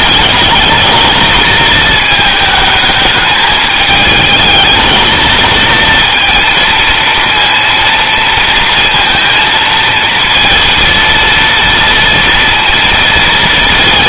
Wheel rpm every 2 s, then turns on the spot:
220, 220, 220, 230, 230, 230, 230.
none